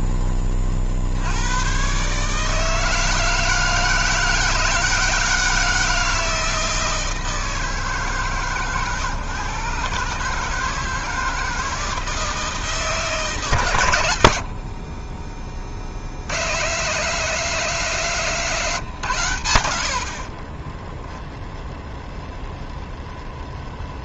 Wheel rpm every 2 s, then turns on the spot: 40, 160, 160, 160, 130, 150, 160, 50, 110, 140, 10, 0.
20-22